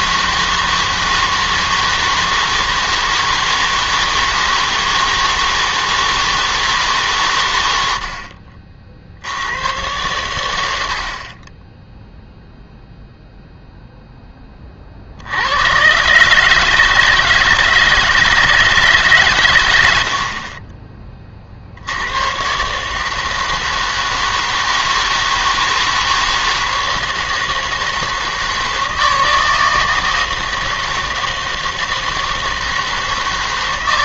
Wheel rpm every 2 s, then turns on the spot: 160, 160, 160, 160, 40, 90, 0, 30, 150, 160, 30, 130, 160, 160, 160, 160, 160.
none